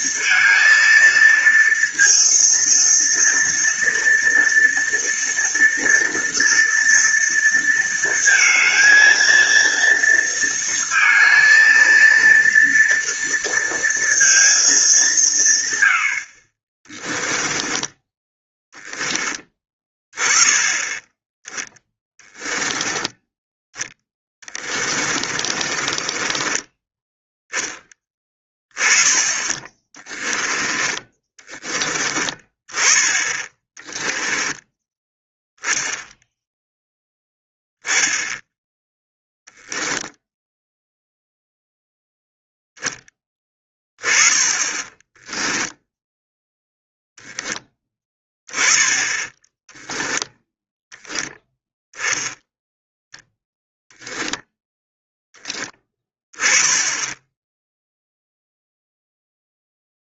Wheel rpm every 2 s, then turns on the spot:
230, 230, 230, 230, 230, 230, 230, 210, 30, 10, 10, 10, 30, 20, 30, 20, 20, 10, 10, 10, 0, 0, 10, 0, 20, 0, 0, 0, 10, 0.
22-26